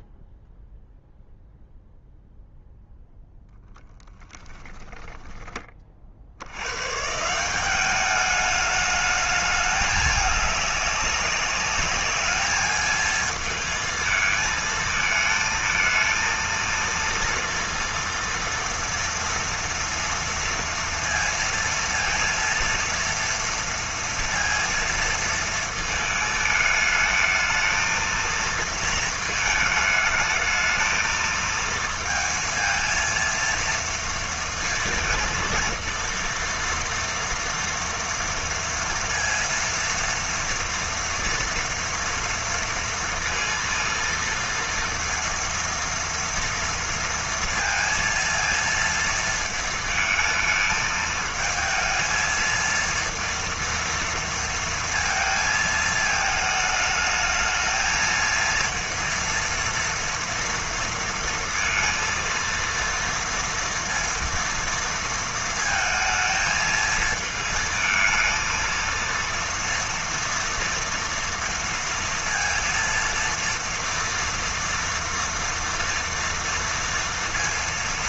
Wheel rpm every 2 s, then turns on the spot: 0, 0, 10, 150, 210, 200, 220, 220, 230, 230, 230, 230, 230, 220, 230, 220, 230, 230, 230, 230, 230, 230, 230, 230, 230, 220, 230, 230, 220, 230, 230, 230, 220, 220, 230, 230, 230, 230, 230.
4-6